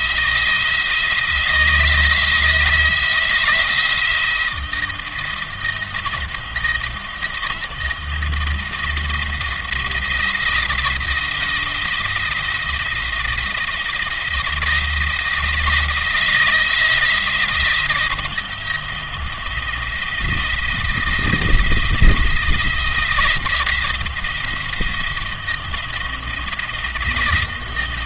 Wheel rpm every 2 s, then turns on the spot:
170, 170, 170, 170, 170, 170, 170, 170, 170, 170, 170, 170, 170, 170.
none